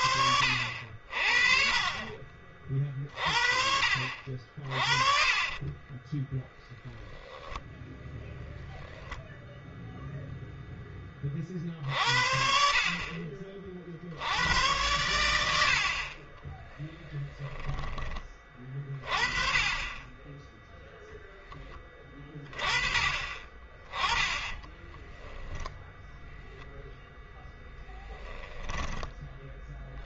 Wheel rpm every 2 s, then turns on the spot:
60, 40, 40, 0, 0, 10, 50, 100, 20, 30, 0, 30, 10, 0, 10.
4-6 16-18 24-26 28-30